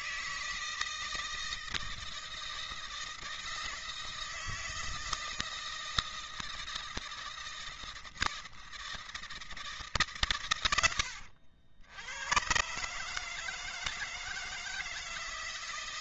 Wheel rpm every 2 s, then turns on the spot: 160, 160, 160, 160, 160, 100, 130, 160.
none